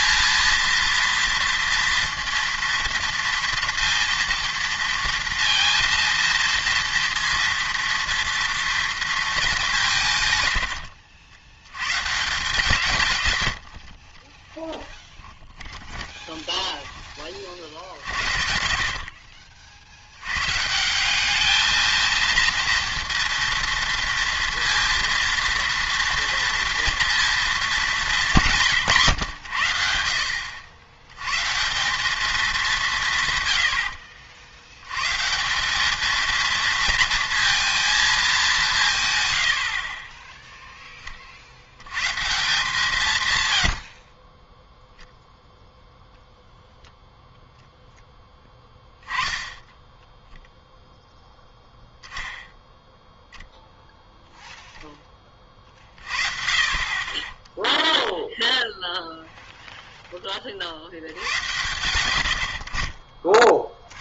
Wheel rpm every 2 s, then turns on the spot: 230, 230, 230, 230, 230, 90, 160, 10, 10, 60, 160, 230, 230, 230, 150, 80, 200, 80, 230, 190, 10, 160, 0, 0, 10, 0, 0, 0, 40, 0, 60, 60.
10-12 14-20